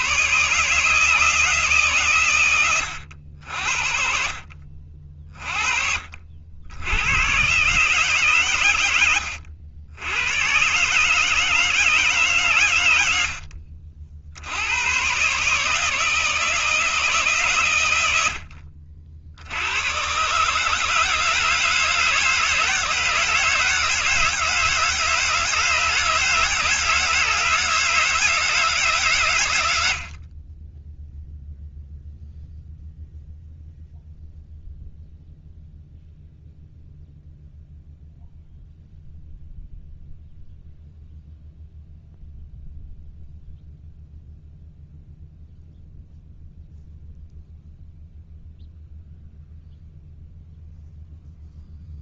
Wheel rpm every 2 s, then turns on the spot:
160, 90, 50, 100, 90, 140, 110, 100, 160, 50, 150, 160, 160, 160, 150, 10, 0, 0, 0, 0, 0, 0, 0, 0, 0, 0.
none